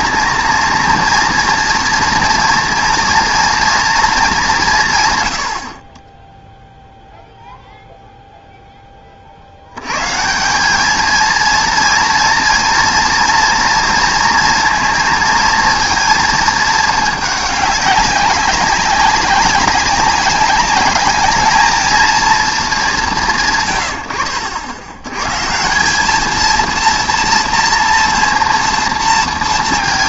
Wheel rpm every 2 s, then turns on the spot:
230, 240, 190, 0, 0, 190, 230, 230, 220, 190, 200, 210, 80, 220, 230.
none